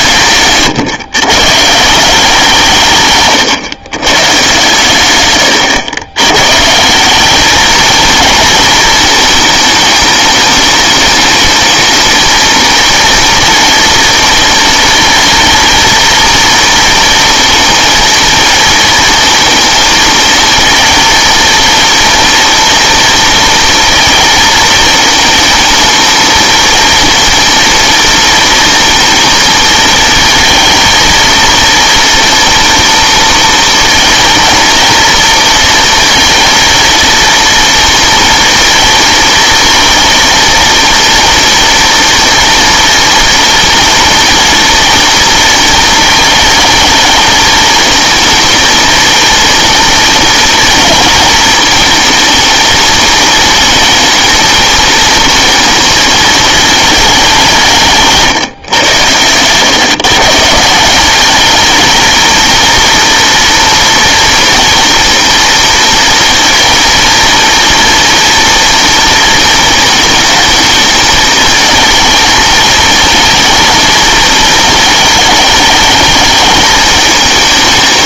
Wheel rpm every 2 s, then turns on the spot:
140, 160, 140, 140, 220, 210, 230, 230, 230, 230, 230, 230, 220, 230, 230, 230, 230, 230, 230, 230, 230, 230, 230, 220, 230, 230, 220, 230, 220, 140, 180, 230, 230, 230, 230, 220, 220, 220, 220.
none